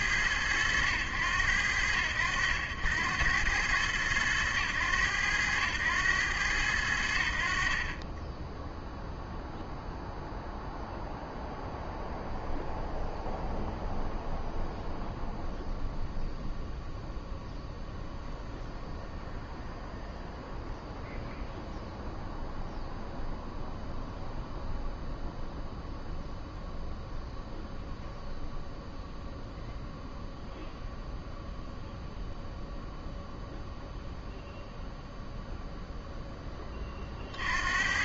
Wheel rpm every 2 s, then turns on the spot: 100, 80, 100, 100, 10, 0, 0, 0, 0, 0, 0, 0, 0, 0, 0, 0, 0, 0, 10.
none